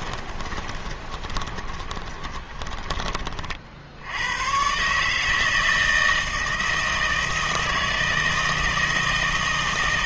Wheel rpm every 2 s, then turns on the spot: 20, 20, 120, 160, 160.
0-4